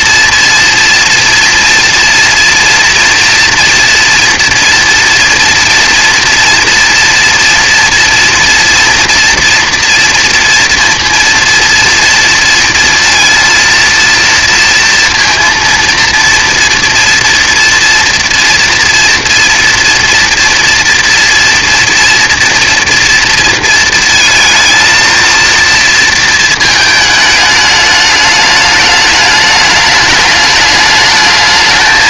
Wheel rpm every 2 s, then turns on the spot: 230, 240, 230, 240, 230, 230, 230, 230, 230, 230, 230, 230, 220, 220, 210, 210.
none